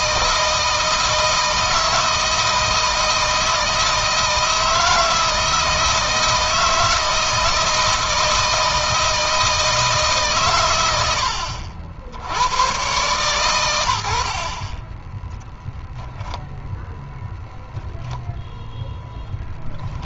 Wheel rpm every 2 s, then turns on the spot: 160, 160, 160, 170, 160, 100, 110, 10, 0, 0.
none